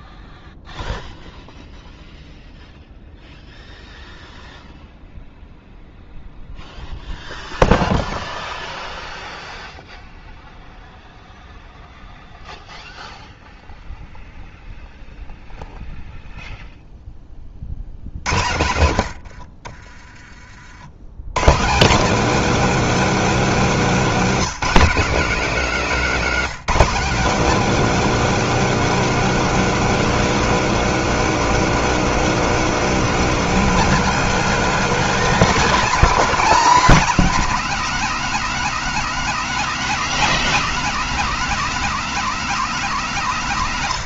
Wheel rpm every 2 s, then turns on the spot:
0, 0, 0, 0, 0, 0, 0, 0, 0, 100, 50, 250, 220, 220, 250, 250, 240, 260, 260, 250, 250, 240.
18-20